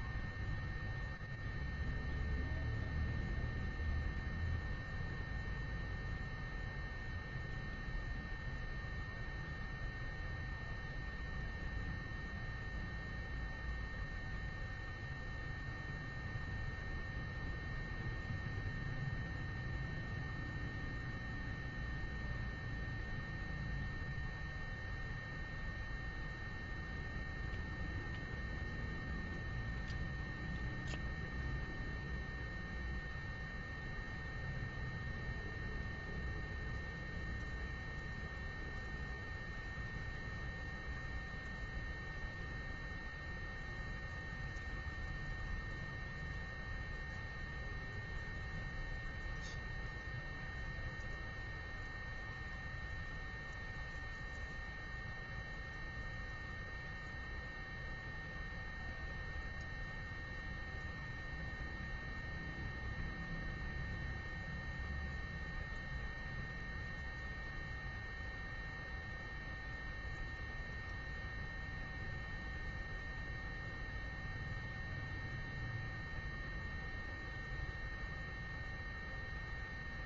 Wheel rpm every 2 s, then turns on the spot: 0, 0, 0, 0, 0, 0, 0, 0, 0, 0, 0, 0, 0, 0, 0, 0, 0, 0, 0, 0, 0, 0, 0, 0, 0, 0, 0, 0, 0, 0, 0, 0, 0, 0, 0, 0, 0, 0, 0, 0.
none